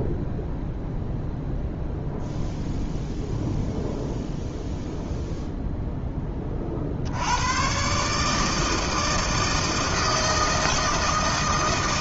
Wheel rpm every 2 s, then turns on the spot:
0, 0, 0, 30, 160, 160.
none